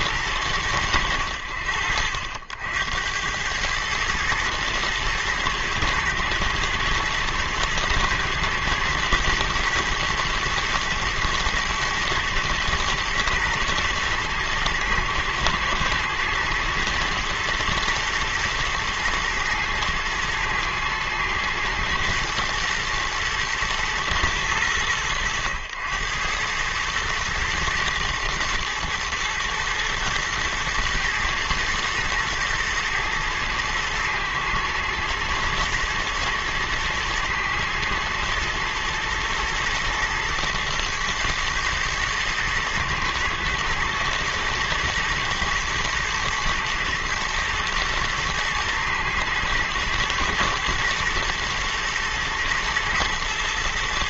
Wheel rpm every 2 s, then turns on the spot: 80, 90, 110, 120, 120, 120, 110, 120, 120, 110, 110, 120, 100, 110, 110, 110, 110, 110, 110, 110, 120, 110, 110, 120, 120, 120, 110.
none